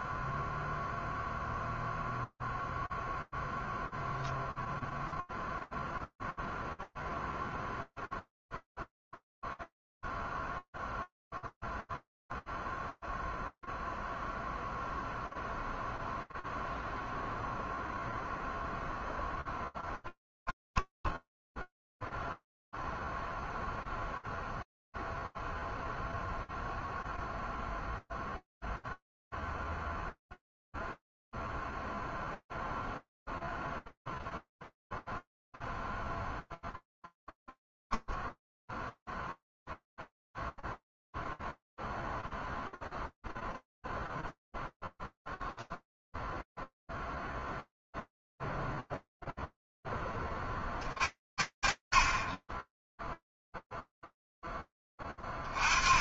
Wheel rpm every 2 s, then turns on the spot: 0, 0, 0, 0, 0, 0, 0, 0, 0, 10, 0, 0, 0, 0, 0, 0, 0, 0, 0, 0, 0, 0, 0, 0, 30, 20, 0, 20.
18-20